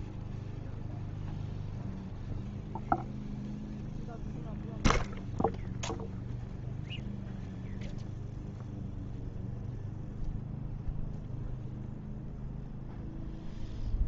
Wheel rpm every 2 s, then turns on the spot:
0, 0, 0, 0, 0, 0, 0.
none